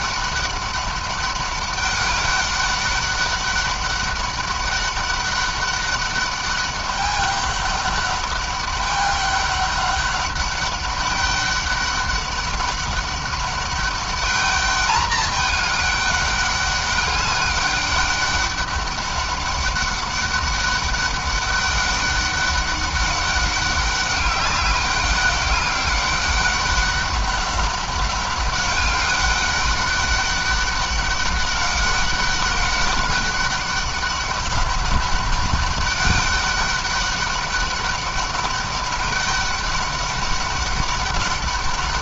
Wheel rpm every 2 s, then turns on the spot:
200, 200, 200, 200, 200, 200, 200, 210, 200, 200, 200, 200, 200, 200, 200, 200, 200, 200, 200, 200, 200.
none